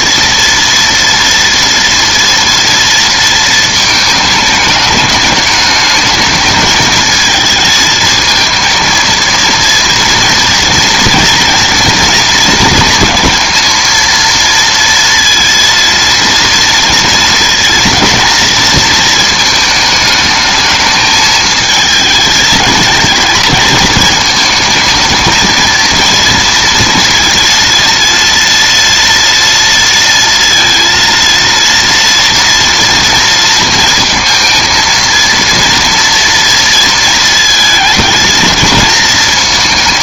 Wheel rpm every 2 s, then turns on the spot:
230, 230, 210, 220, 220, 230, 230, 230, 230, 230, 210, 220, 220, 230, 230, 230, 230, 230, 230, 220.
none